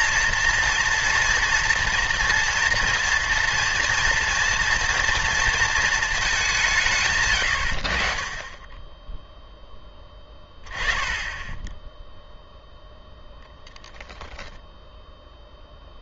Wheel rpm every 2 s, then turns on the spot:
230, 230, 230, 160, 10, 10, 0, 0.
none